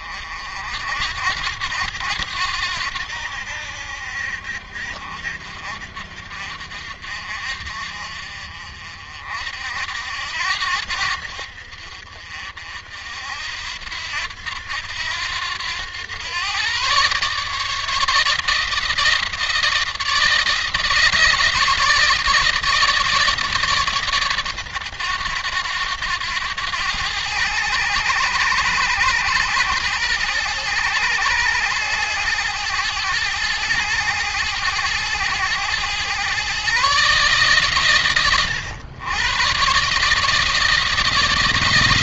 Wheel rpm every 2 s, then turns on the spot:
70, 90, 60, 60, 50, 80, 60, 90, 130, 160, 160, 150, 120, 90, 100, 100, 100, 110, 140, 120, 160.
none